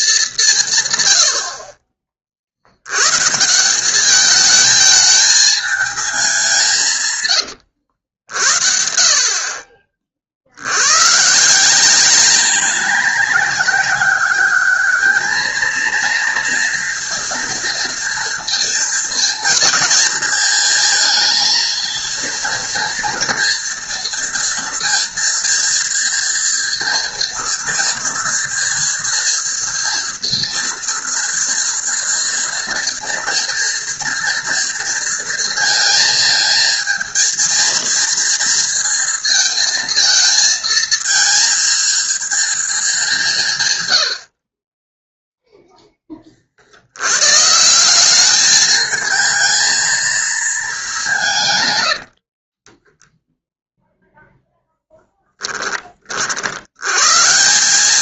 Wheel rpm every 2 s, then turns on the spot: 70, 150, 220, 100, 50, 130, 190, 220, 230, 230, 220, 230, 230, 230, 230, 230, 230, 230, 230, 230, 230, 200, 10, 100, 220, 180, 10, 0, 90.
6-8 52-54